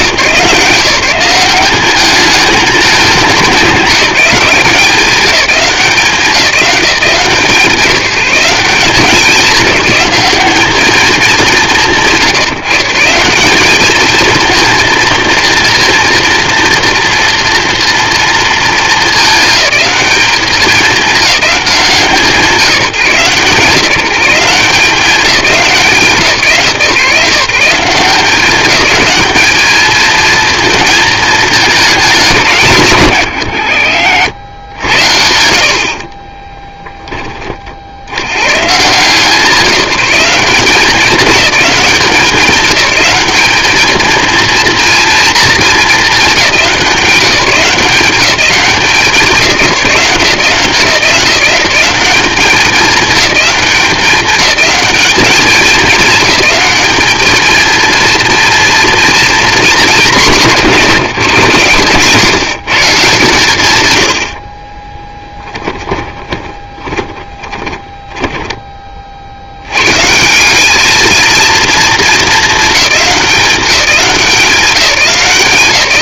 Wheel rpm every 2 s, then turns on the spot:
170, 210, 180, 170, 180, 210, 160, 230, 230, 220, 210, 160, 180, 150, 210, 220, 140, 80, 10, 140, 200, 210, 230, 180, 180, 170, 200, 210, 220, 230, 160, 150, 20, 20, 30, 210, 210, 170.
64-68